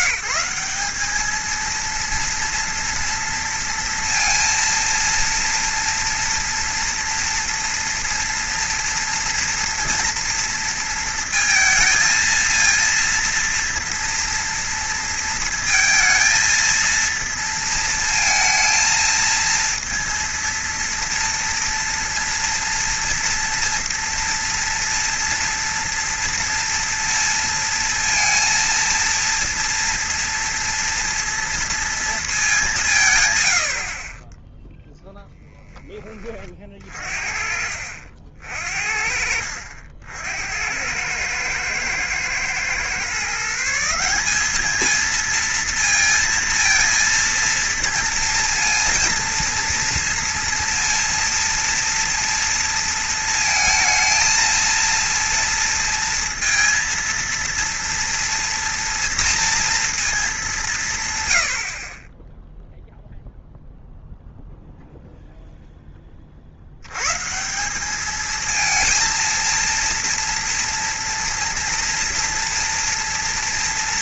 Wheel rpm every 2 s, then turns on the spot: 190, 230, 230, 230, 230, 230, 230, 230, 230, 230, 230, 230, 230, 230, 230, 230, 180, 0, 40, 50, 90, 120, 220, 230, 230, 230, 230, 230, 230, 230, 200, 0, 0, 80, 220, 230, 240.
none